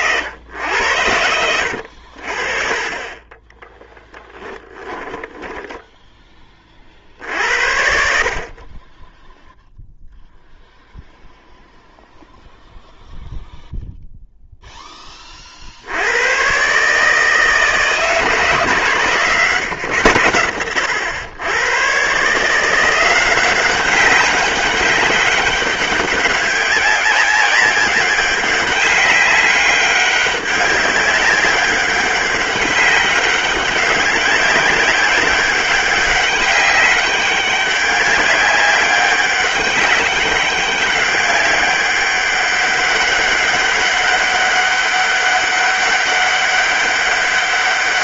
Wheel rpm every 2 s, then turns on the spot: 90, 30, 10, 50, 20, 0, 0, 20, 150, 140, 100, 180, 200, 190, 200, 200, 190, 190, 200, 190, 200, 190, 200, 200.
0-2 4-6